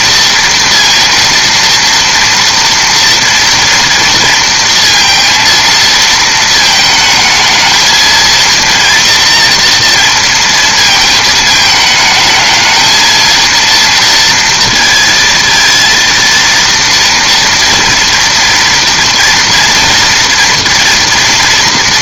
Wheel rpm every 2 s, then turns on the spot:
230, 230, 230, 220, 230, 220, 220, 230, 230, 230, 230.
none